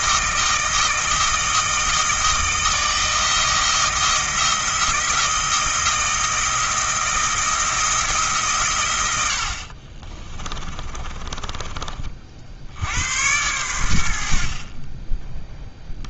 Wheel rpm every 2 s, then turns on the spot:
160, 160, 170, 170, 110, 30, 80, 20.
10-12